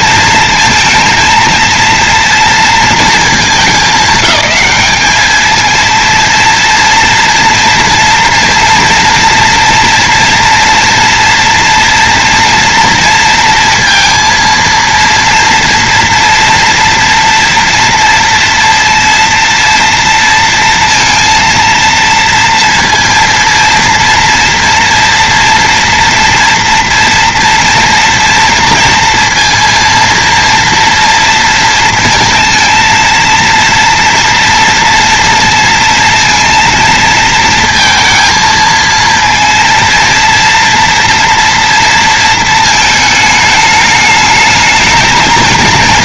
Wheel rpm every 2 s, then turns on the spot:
230, 220, 200, 230, 230, 230, 230, 230, 230, 230, 230, 230, 230, 230, 230, 230, 230, 230, 230, 230, 230, 220, 220.
none